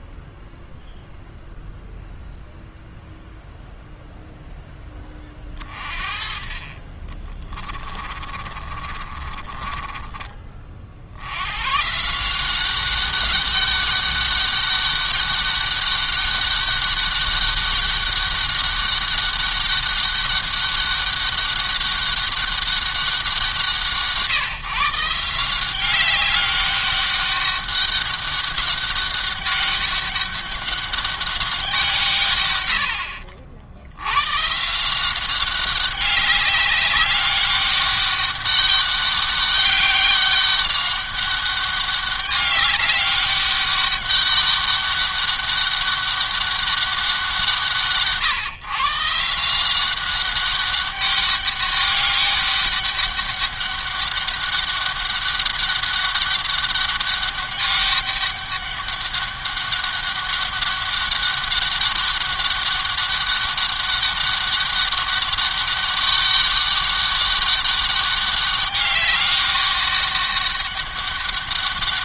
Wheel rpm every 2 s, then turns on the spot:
0, 0, 10, 30, 30, 60, 190, 200, 200, 200, 200, 190, 160, 200, 200, 200, 80, 170, 200, 200, 200, 200, 200, 190, 150, 200, 200, 200, 200, 200, 200, 200, 200, 200, 200, 200.
6-10